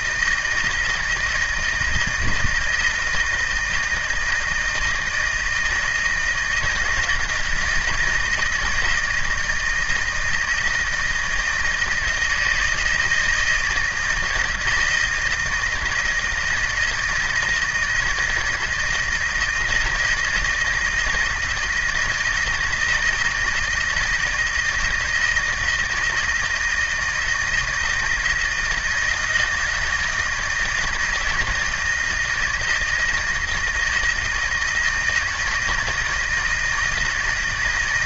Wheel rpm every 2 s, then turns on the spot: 160, 160, 160, 160, 160, 160, 160, 160, 160, 160, 160, 160, 160, 160, 170, 160, 160, 160, 160.
none